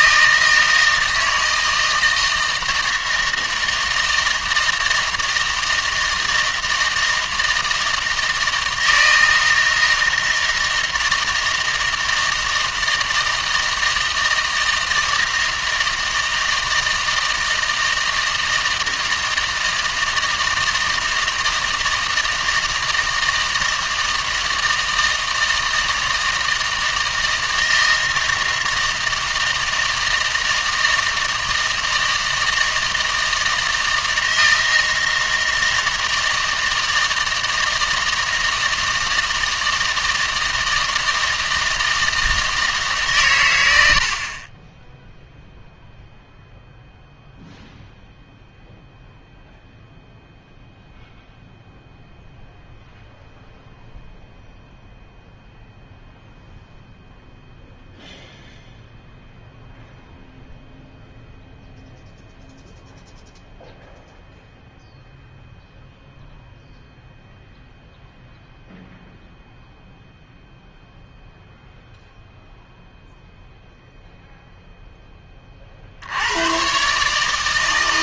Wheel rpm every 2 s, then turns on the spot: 160, 160, 160, 160, 160, 160, 160, 160, 160, 160, 160, 160, 160, 160, 160, 160, 160, 160, 160, 160, 160, 150, 10, 0, 0, 0, 0, 0, 0, 0, 0, 0, 0, 0, 0, 0, 0, 0, 130.
none